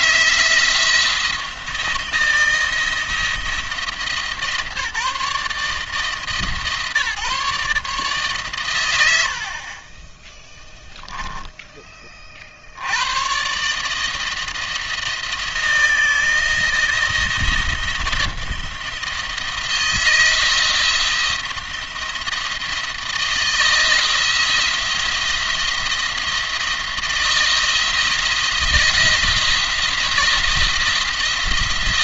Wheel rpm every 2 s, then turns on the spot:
170, 170, 160, 150, 110, 10, 70, 160, 170, 170, 170, 160, 170, 170, 170, 170.
none